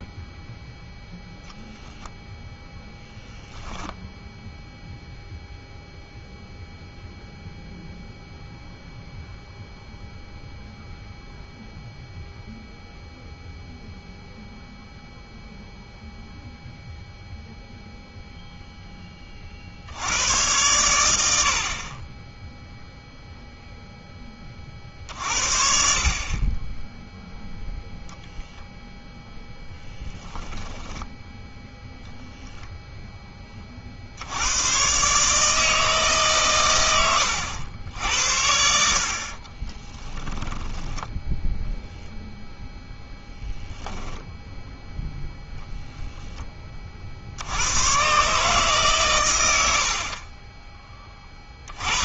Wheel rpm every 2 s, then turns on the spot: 0, 0, 0, 0, 0, 0, 0, 0, 0, 0, 110, 0, 40, 20, 0, 10, 0, 100, 110, 70, 10, 0, 0, 10, 140, 20.
30-32 40-42